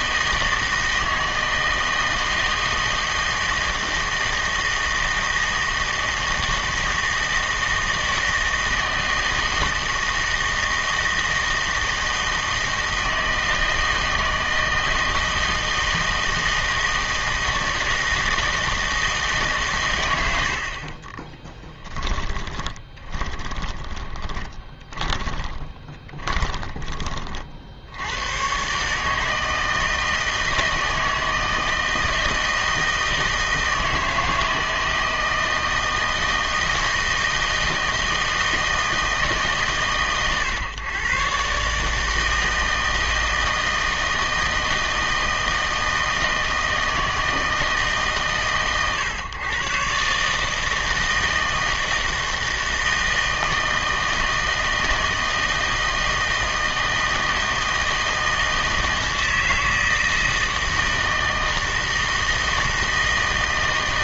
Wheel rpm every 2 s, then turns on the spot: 160, 160, 160, 160, 160, 160, 160, 160, 160, 160, 60, 20, 20, 20, 130, 160, 160, 160, 160, 160, 130, 160, 160, 160, 130, 160, 160, 160, 160, 160, 160, 160.
22-26